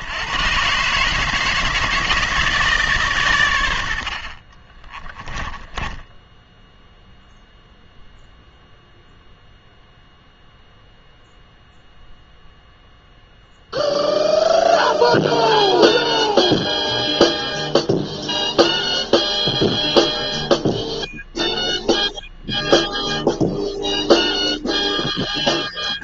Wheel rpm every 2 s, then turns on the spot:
130, 150, 20, 0, 0, 0, 0, 0, 0, 0, 0, 0, 0.
4-6